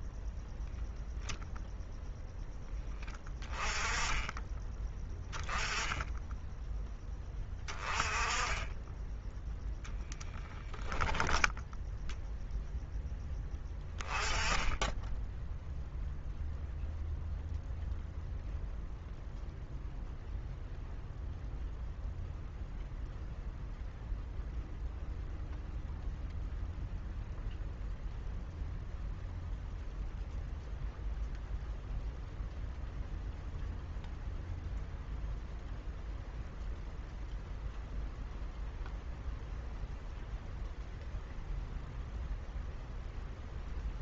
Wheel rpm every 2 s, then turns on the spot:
0, 10, 20, 10, 10, 10, 0, 10, 0, 0, 0, 0, 0, 0, 0, 0, 0, 0, 0, 0, 0, 0.
none